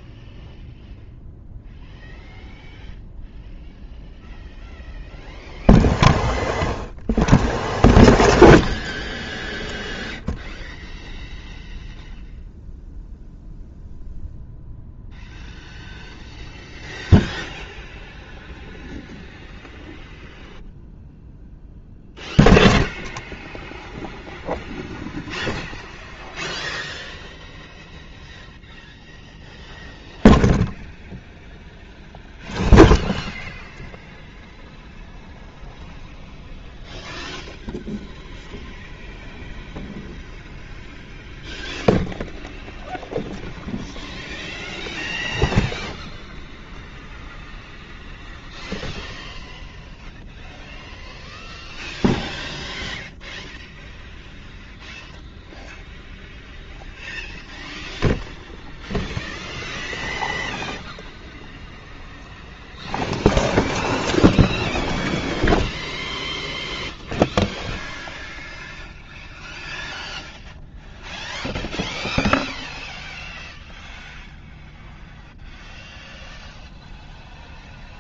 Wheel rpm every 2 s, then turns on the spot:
0, 0, 0, 0, 0, 0, 0, 0, 0, 0, 0, 0, 0, 0, 0, 0, 0, 0, 0, 0, 0, 0, 0, 0, 0, 0, 0, 0, 0, 0, 0, 0, 0, 0, 0, 0, 0, 0, 0.
none